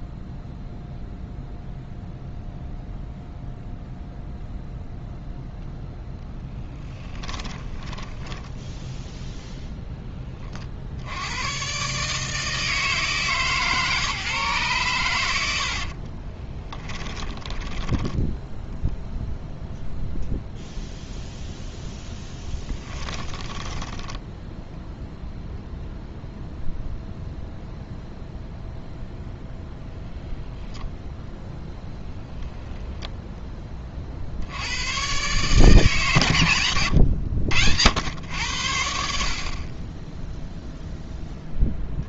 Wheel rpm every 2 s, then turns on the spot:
0, 0, 0, 10, 0, 60, 150, 120, 10, 0, 0, 20, 0, 0, 0, 0, 0, 100, 140, 90, 0.
6-8 16-18 22-24